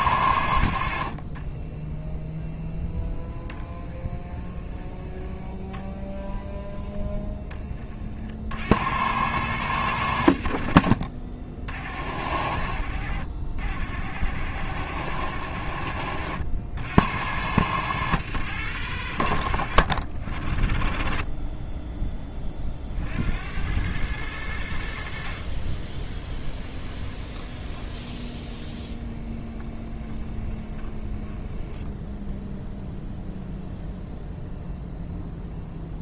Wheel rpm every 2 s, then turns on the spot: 60, 0, 10, 0, 90, 60, 80, 90, 80, 90, 30, 50, 70, 20, 20, 20, 0, 0.
26-32